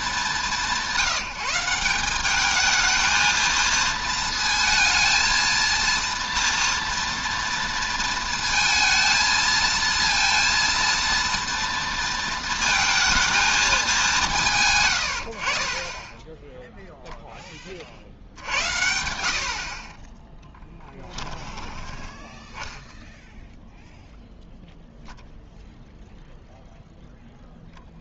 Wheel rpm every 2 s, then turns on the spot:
190, 220, 230, 230, 230, 230, 220, 110, 0, 80, 10, 0, 0, 0.
none